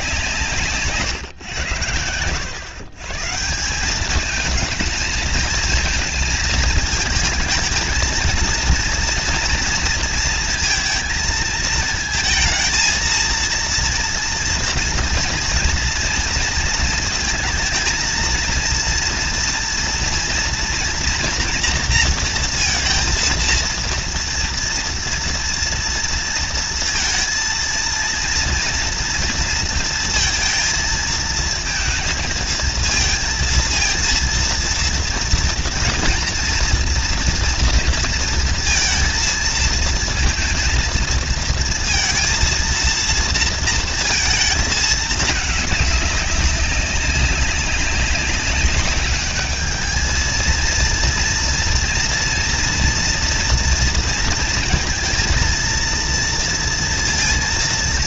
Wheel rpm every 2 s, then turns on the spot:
160, 110, 210, 220, 230, 230, 220, 230, 230, 230, 230, 230, 230, 230, 230, 230, 230, 230, 230, 230, 230, 230, 230, 200, 200, 230, 230, 230, 230.
none